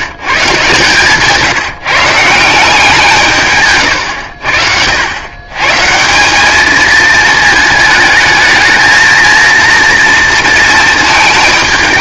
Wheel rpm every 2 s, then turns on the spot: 150, 170, 80, 210, 220, 230.
none